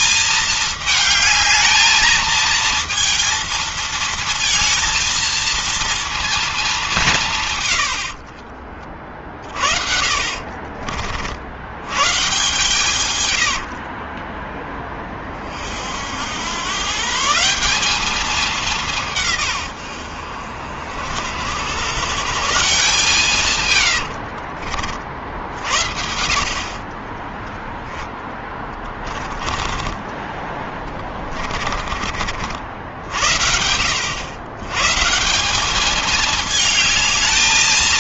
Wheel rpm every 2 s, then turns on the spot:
210, 230, 230, 180, 40, 60, 100, 30, 150, 160, 70, 150, 70, 20, 20, 30, 70, 150, 220.
12-14 28-32